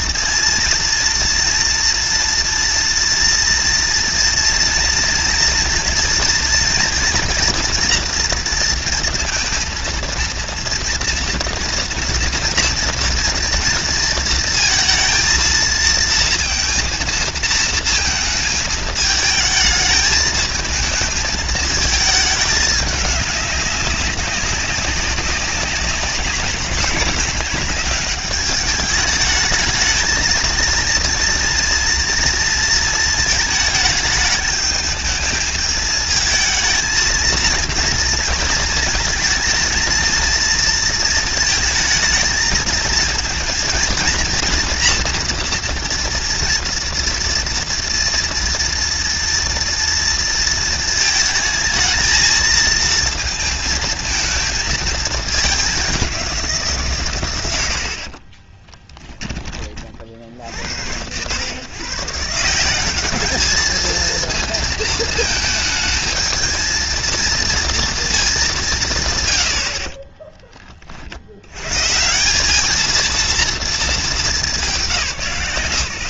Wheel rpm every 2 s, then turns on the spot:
240, 230, 230, 240, 230, 230, 230, 230, 230, 220, 220, 210, 200, 210, 200, 230, 230, 220, 220, 230, 230, 220, 230, 230, 230, 230, 230, 220, 160, 20, 70, 180, 230, 220, 180, 20, 210, 180.
58-60